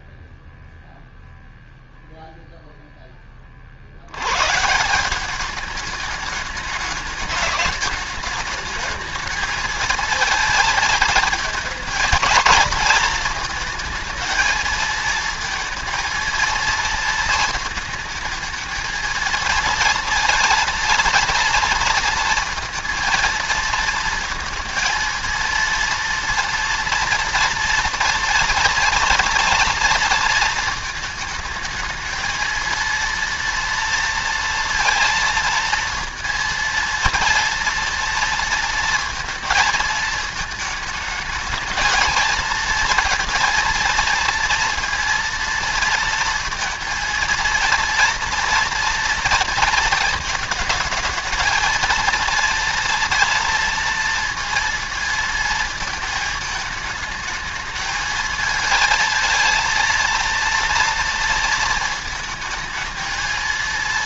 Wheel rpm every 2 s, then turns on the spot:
0, 0, 160, 210, 210, 220, 230, 230, 230, 220, 230, 230, 230, 230, 230, 220, 230, 230, 230, 230, 220, 220, 230, 230, 230, 220, 230, 230, 220, 220, 230, 220.
none